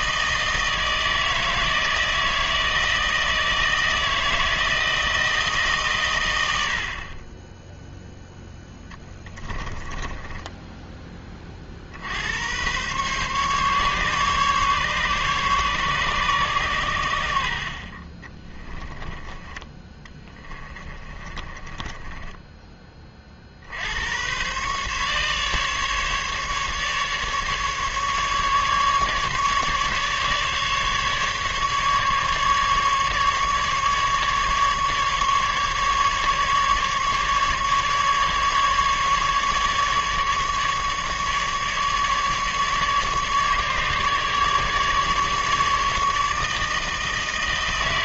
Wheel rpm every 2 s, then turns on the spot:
160, 160, 160, 50, 10, 10, 120, 140, 100, 20, 20, 20, 130, 150, 150, 140, 150, 150, 150, 150, 150, 150, 150, 160.
18-22